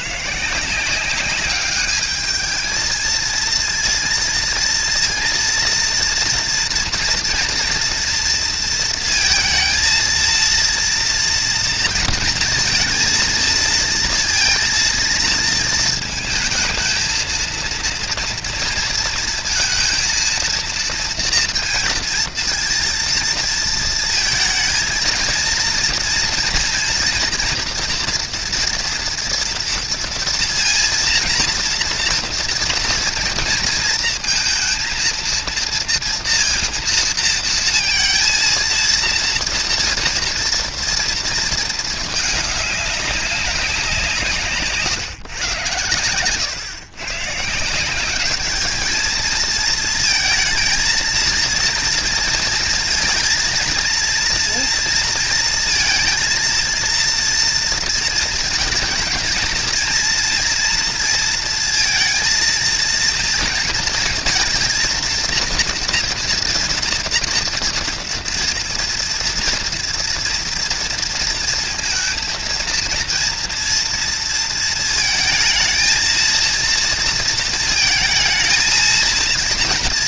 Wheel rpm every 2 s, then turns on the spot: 180, 220, 230, 230, 230, 230, 230, 230, 230, 230, 230, 230, 220, 240, 230, 230, 230, 230, 230, 230, 230, 210, 140, 130, 220, 220, 230, 230, 230, 230, 230, 230, 230, 240, 230, 230, 230, 230, 230, 230.
none